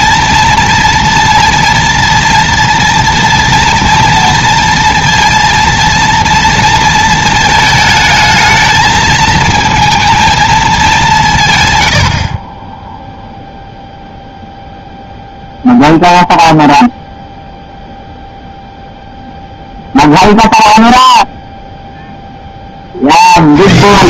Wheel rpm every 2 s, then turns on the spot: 230, 230, 230, 230, 220, 210, 20, 0, 0, 0, 0, 30.
none